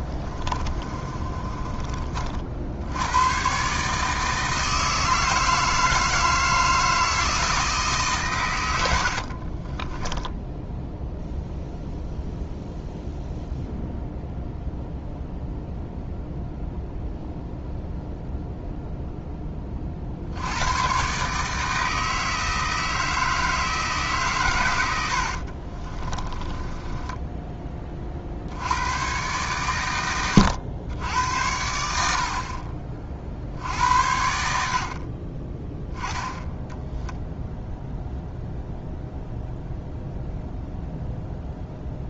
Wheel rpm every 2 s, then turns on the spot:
30, 90, 160, 160, 90, 0, 0, 0, 0, 0, 110, 160, 100, 20, 100, 100, 50, 60, 0, 0, 0.
0-2 8-10 26-28